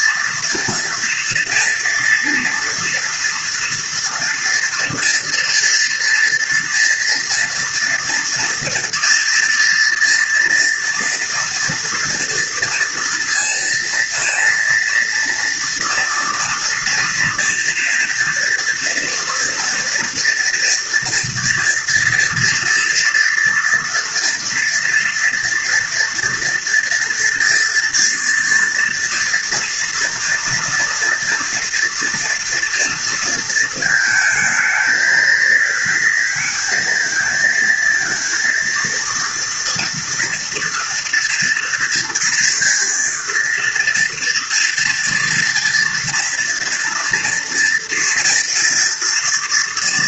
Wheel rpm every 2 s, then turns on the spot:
230, 240, 230, 230, 230, 230, 230, 230, 230, 230, 240, 230, 230, 230, 230, 230, 240, 220, 230, 230, 230, 230, 230, 230, 230.
none